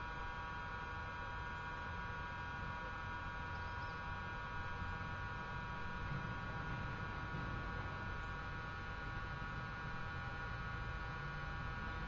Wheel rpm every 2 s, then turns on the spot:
0, 0, 0, 0, 0, 0.
none